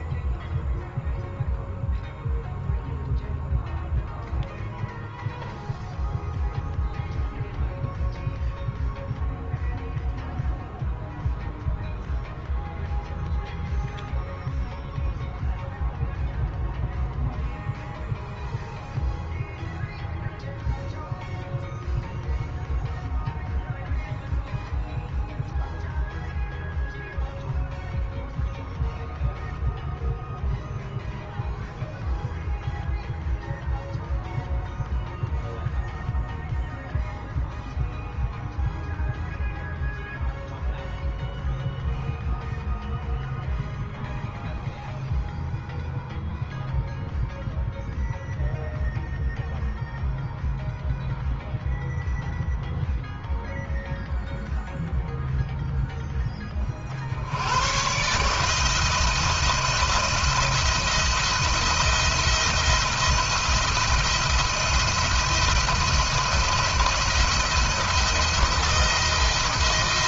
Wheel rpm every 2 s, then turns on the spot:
0, 0, 0, 0, 0, 0, 0, 0, 0, 0, 0, 0, 0, 0, 0, 0, 0, 0, 0, 0, 0, 0, 0, 0, 0, 0, 0, 0, 40, 160, 170, 170, 170, 170, 170.
none